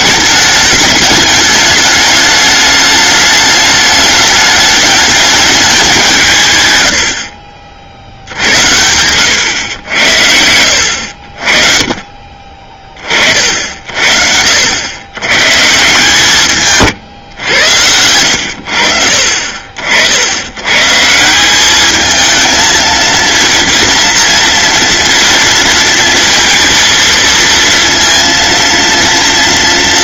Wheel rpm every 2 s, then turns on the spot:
210, 210, 210, 110, 90, 70, 40, 80, 140, 60, 140, 230, 230, 230, 230.
none